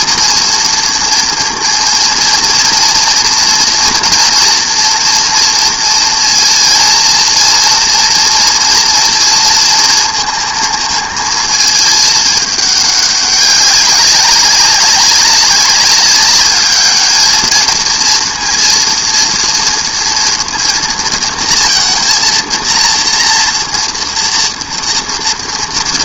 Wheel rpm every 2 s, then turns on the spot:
230, 230, 230, 230, 230, 230, 210, 200, 210, 230, 230, 230, 230.
none